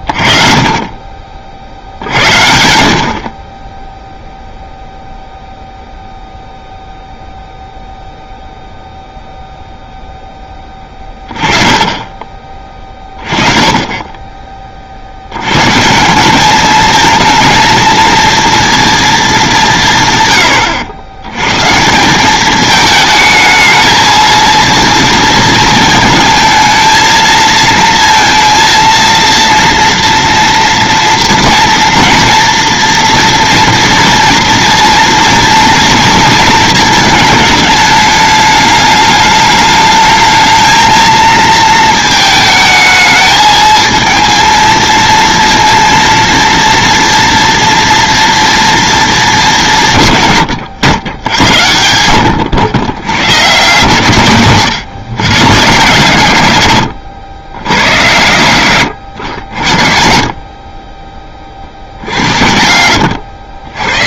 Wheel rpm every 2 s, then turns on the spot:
30, 70, 0, 0, 0, 20, 20, 40, 220, 230, 100, 220, 230, 230, 230, 230, 230, 230, 220, 210, 220, 220, 230, 230, 230, 110, 90, 130, 100, 100, 30, 80.
62-64